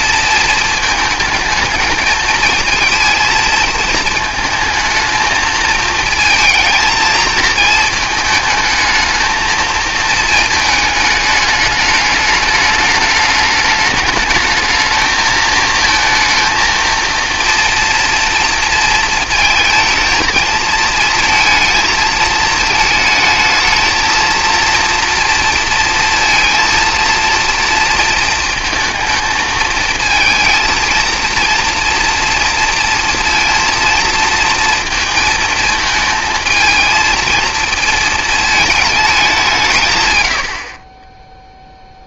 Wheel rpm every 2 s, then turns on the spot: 220, 230, 220, 220, 220, 220, 210, 220, 230, 230, 230, 220, 230, 230, 220, 230, 230, 230, 230, 220, 60.
none